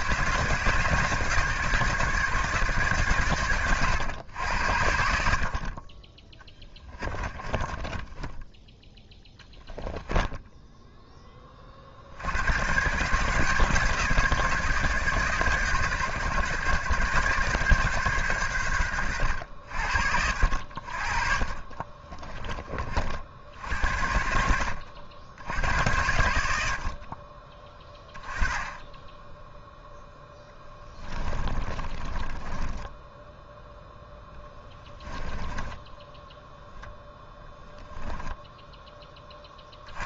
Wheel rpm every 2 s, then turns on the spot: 160, 140, 60, 20, 10, 10, 110, 150, 130, 100, 50, 40, 80, 70, 20, 10, 10, 10, 10, 10.
6-8 30-36